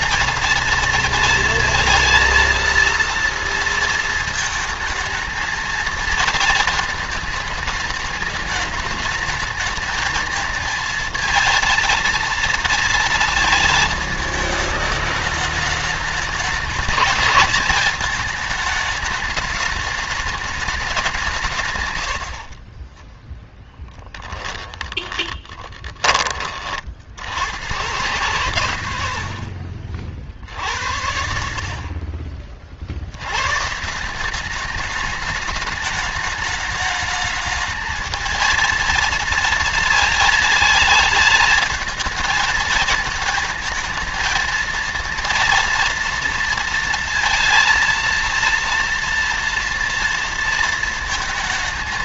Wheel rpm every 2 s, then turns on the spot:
230, 230, 230, 230, 210, 220, 230, 220, 210, 210, 200, 40, 20, 40, 110, 70, 50, 210, 220, 220, 220, 220, 230, 230, 230, 230.
22-26